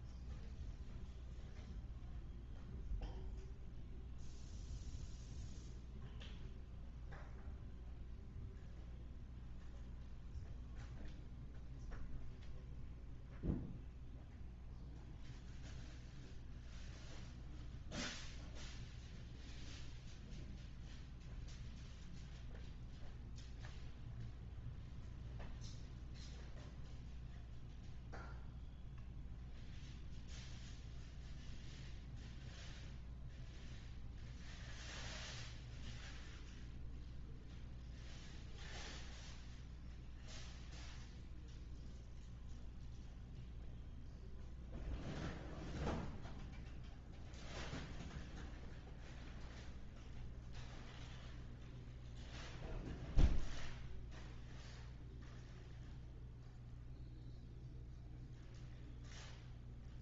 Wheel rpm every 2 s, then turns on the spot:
0, 0, 0, 0, 0, 0, 0, 0, 0, 0, 0, 0, 0, 0, 0, 0, 0, 0, 0, 0, 0, 0, 0, 0, 0, 0, 0, 0, 0, 0.
none